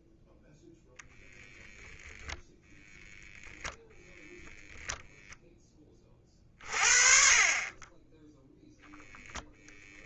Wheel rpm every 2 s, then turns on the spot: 0, 10, 0, 20, 0.
none